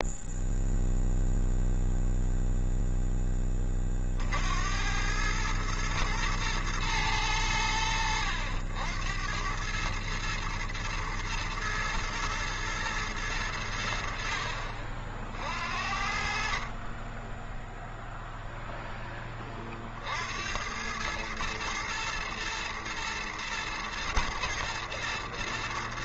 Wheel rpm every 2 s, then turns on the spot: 0, 10, 100, 110, 90, 110, 110, 50, 30, 10, 100, 110, 110.
none